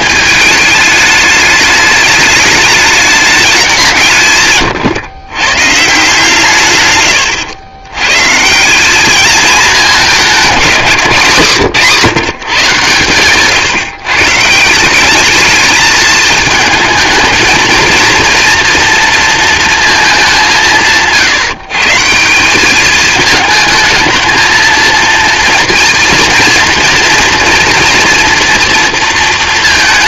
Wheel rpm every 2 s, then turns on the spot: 210, 210, 130, 130, 200, 170, 130, 190, 230, 230, 140, 200, 230, 240, 230.
none